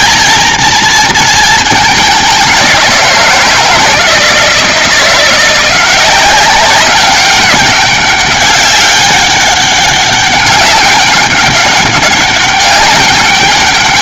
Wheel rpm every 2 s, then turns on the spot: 220, 190, 160, 190, 200, 200, 200.
none